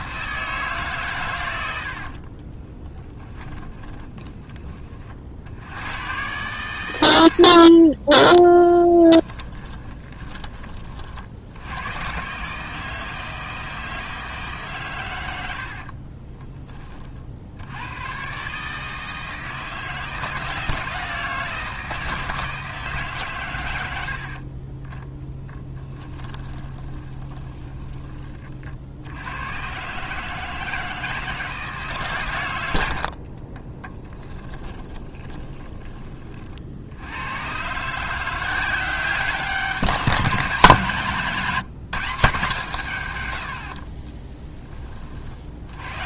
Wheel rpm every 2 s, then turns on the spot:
150, 20, 30, 100, 10, 30, 150, 130, 20, 150, 160, 160, 30, 20, 60, 160, 90, 20, 70, 180, 180, 140, 20.
2-4 8-10 24-28 34-36